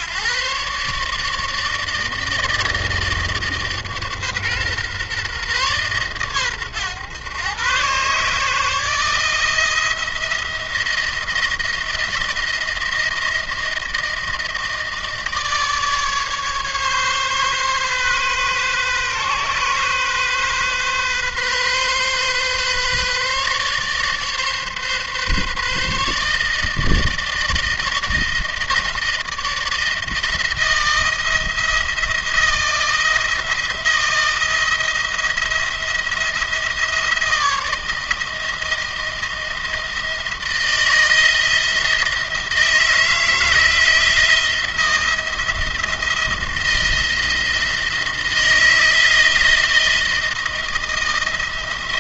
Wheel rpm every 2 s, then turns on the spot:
140, 160, 140, 120, 160, 170, 170, 160, 140, 130, 130, 140, 140, 160, 160, 160, 170, 170, 160, 170, 160, 160, 170, 170, 170, 160.
none